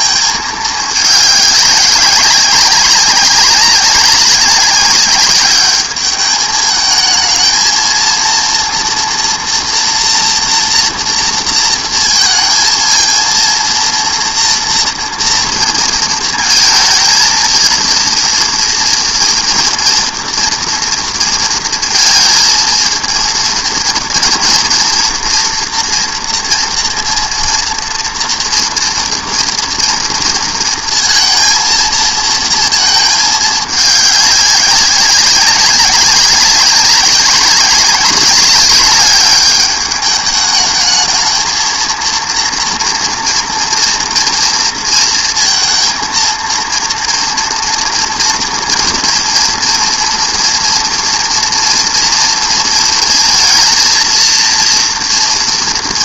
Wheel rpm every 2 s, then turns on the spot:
220, 190, 200, 210, 230, 240, 220, 230, 230, 240, 230, 220, 230, 230, 230, 230, 220, 200, 190, 210, 210, 230, 230, 230, 230, 240, 230, 230.
none